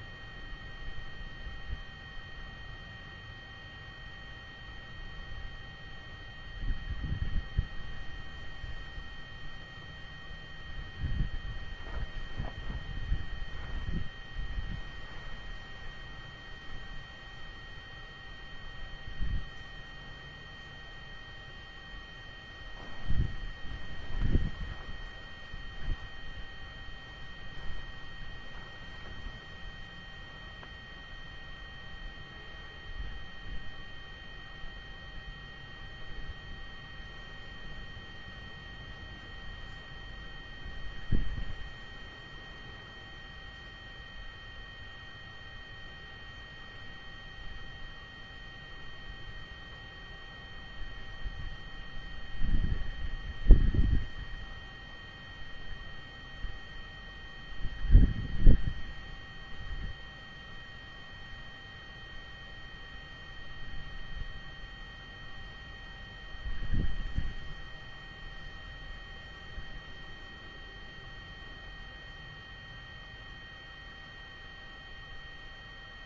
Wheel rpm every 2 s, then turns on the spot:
0, 0, 0, 0, 0, 0, 0, 0, 0, 0, 0, 0, 0, 0, 0, 0, 0, 0, 0, 0, 0, 0, 0, 0, 0, 0, 0, 0, 0, 0, 0, 0, 0, 0, 0, 0, 0, 0.
none